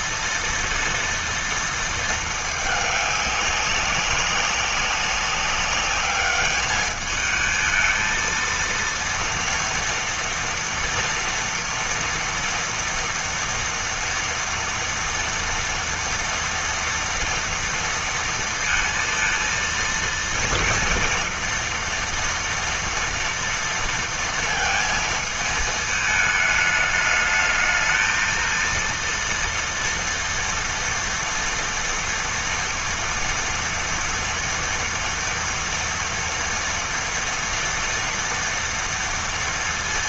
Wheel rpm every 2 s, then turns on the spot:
230, 200, 190, 220, 230, 230, 230, 240, 230, 230, 230, 230, 220, 210, 230, 230, 230, 230, 230, 230.
none